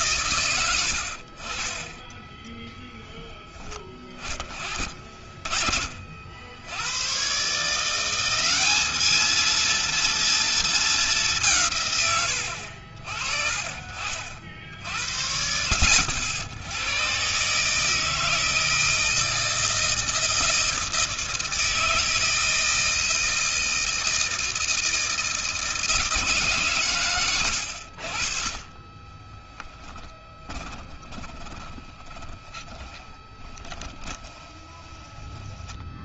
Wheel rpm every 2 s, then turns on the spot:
20, 30, 40, 160, 230, 140, 40, 80, 150, 160, 160, 160, 160, 90, 20, 20, 20, 40.
0-2 26-34